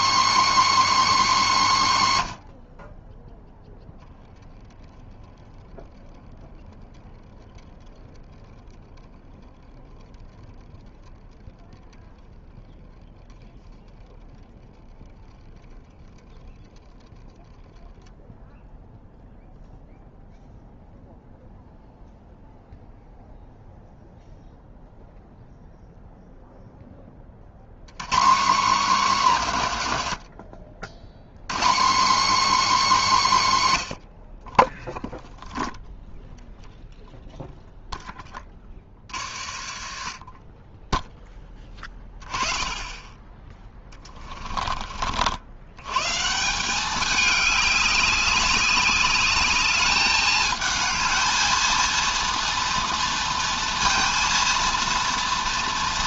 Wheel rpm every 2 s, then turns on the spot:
300, 70, 0, 0, 10, 0, 10, 0, 0, 0, 0, 0, 0, 0, 230, 90, 270, 20, 0, 40, 20, 20, 30, 180, 200, 220, 230, 230.
38-42